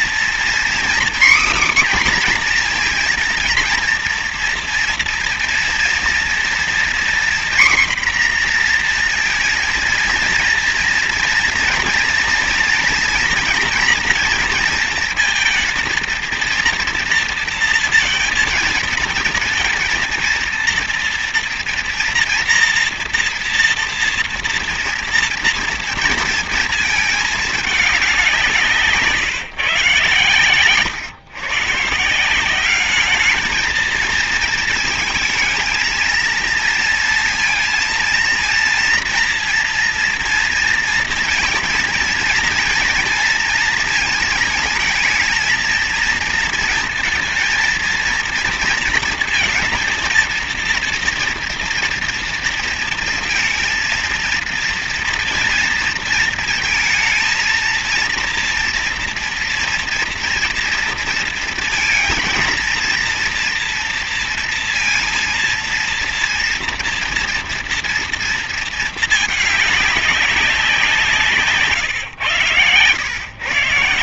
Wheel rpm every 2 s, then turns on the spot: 250, 250, 230, 240, 240, 230, 230, 230, 230, 220, 230, 230, 230, 220, 170, 110, 190, 220, 230, 230, 230, 230, 220, 230, 230, 230, 230, 230, 230, 230, 230, 230, 230, 230, 230, 190, 120.
none